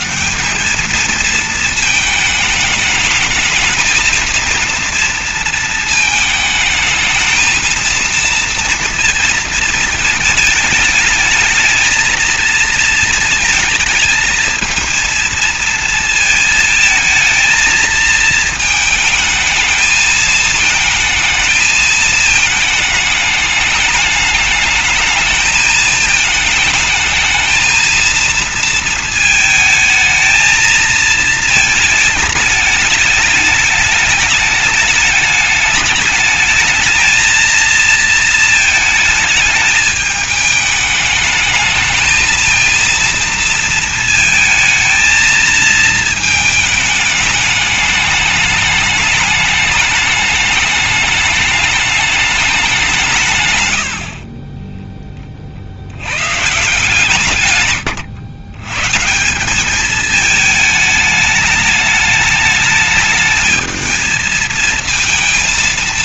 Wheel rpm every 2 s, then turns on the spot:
220, 220, 230, 220, 230, 210, 220, 220, 220, 220, 220, 220, 210, 220, 230, 220, 210, 210, 220, 220, 210, 230, 220, 210, 210, 210, 190, 10, 150, 130, 210, 210, 220.
none